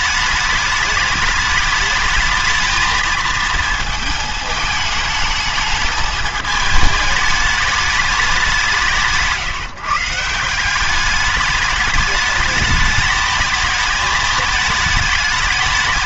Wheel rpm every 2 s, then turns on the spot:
210, 220, 210, 210, 170, 180, 210, 220.
none